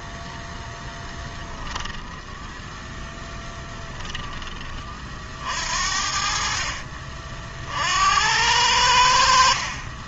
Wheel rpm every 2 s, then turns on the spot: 10, 10, 40, 40, 80.
2-4